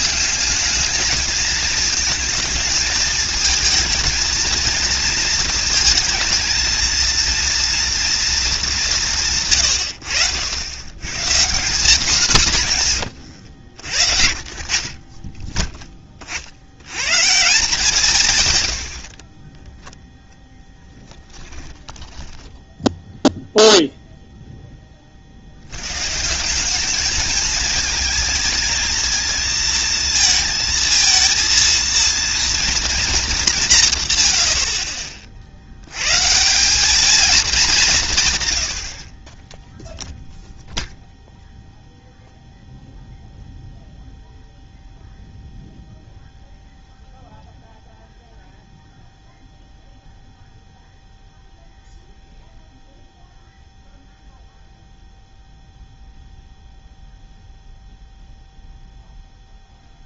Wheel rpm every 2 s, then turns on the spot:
210, 220, 220, 230, 210, 100, 180, 60, 70, 100, 10, 10, 10, 190, 220, 220, 230, 60, 180, 100, 0, 0, 0, 0, 0, 0, 0, 0, 0, 0.
20-24